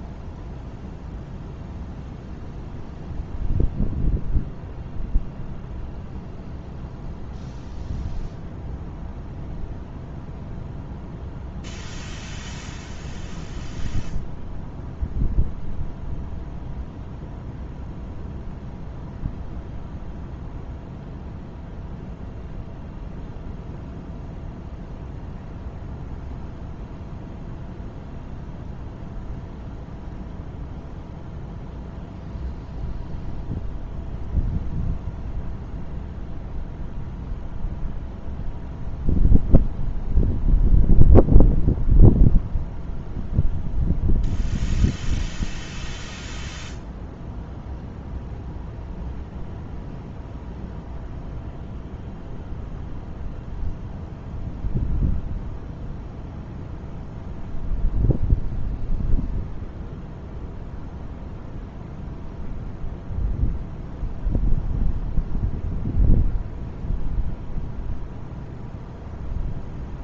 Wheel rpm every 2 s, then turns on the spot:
0, 0, 0, 0, 0, 0, 0, 0, 0, 0, 0, 0, 0, 0, 0, 0, 0, 0, 0, 0, 0, 0, 0, 0, 0, 0, 0, 0, 0, 0, 0, 0, 0, 0, 0.
none